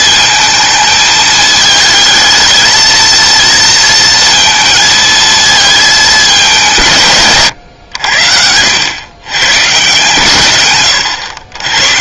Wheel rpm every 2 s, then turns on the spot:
220, 230, 230, 170, 90, 120.
none